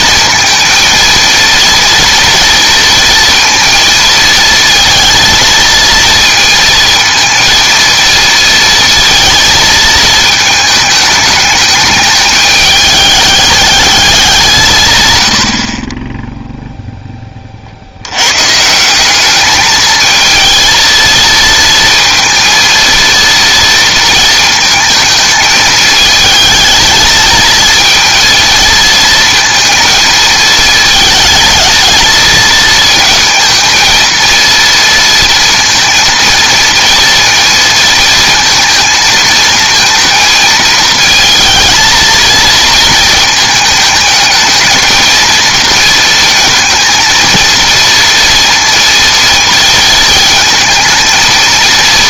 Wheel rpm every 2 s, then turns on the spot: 230, 230, 230, 230, 230, 210, 210, 150, 0, 150, 230, 230, 230, 220, 230, 220, 220, 230, 230, 230, 220, 220, 220, 220, 230, 230.
none